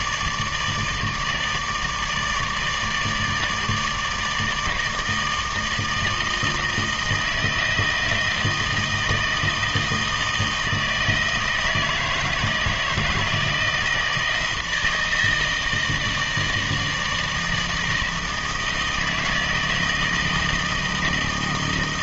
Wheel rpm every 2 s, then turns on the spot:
160, 150, 160, 160, 160, 160, 160, 160, 160, 160, 160.
none